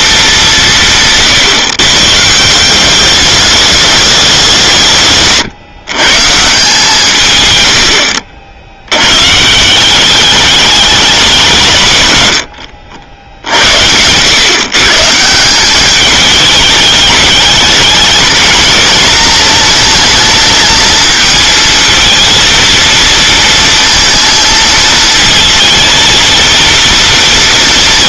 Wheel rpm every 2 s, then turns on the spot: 180, 180, 150, 170, 90, 210, 90, 140, 210, 230, 220, 230, 230, 230.
none